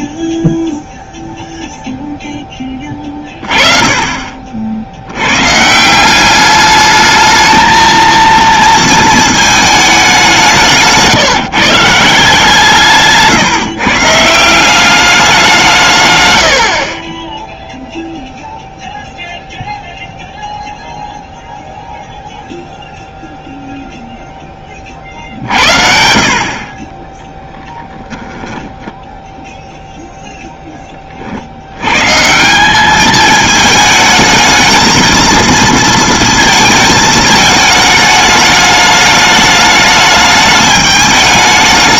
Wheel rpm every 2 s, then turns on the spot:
0, 20, 80, 210, 220, 160, 150, 200, 50, 0, 0, 0, 20, 30, 0, 0, 160, 220, 220, 210, 210.
none